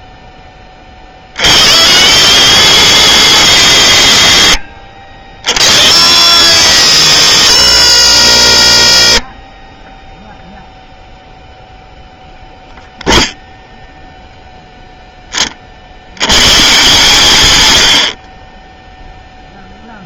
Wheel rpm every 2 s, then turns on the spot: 20, 110, 60, 80, 40, 0, 0, 10, 160, 0.
none